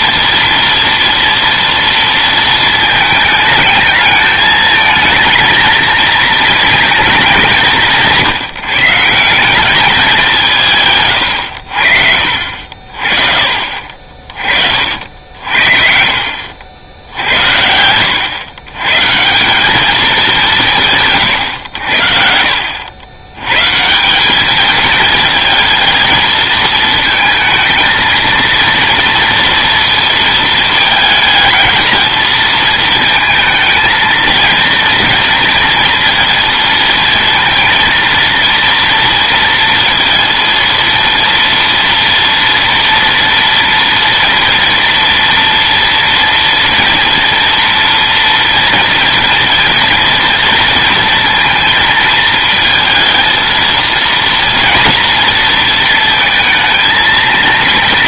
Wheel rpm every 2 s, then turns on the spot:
230, 220, 220, 230, 150, 160, 50, 50, 70, 120, 170, 70, 210, 220, 230, 220, 230, 230, 230, 230, 230, 230, 230, 230, 230, 230, 220, 230, 220.
none